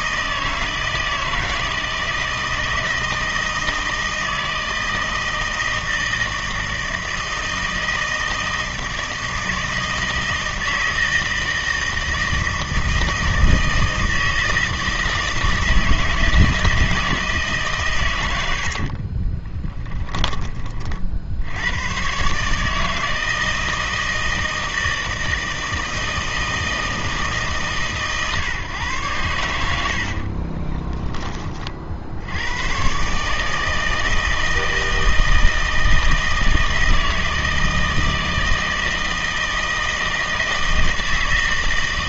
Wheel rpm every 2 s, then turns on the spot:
160, 160, 160, 160, 160, 160, 160, 160, 160, 70, 30, 150, 160, 160, 130, 20, 120, 160, 160, 160, 160.
18-20 30-32